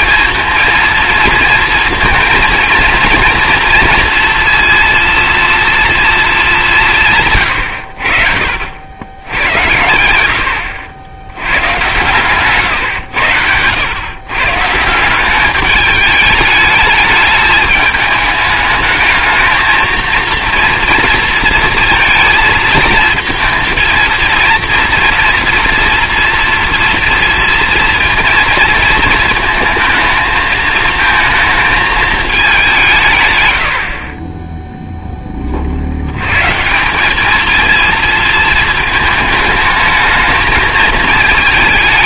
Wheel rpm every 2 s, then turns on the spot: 230, 230, 230, 190, 70, 80, 130, 140, 210, 210, 230, 220, 230, 230, 230, 220, 200, 10, 150, 220, 220.
34-36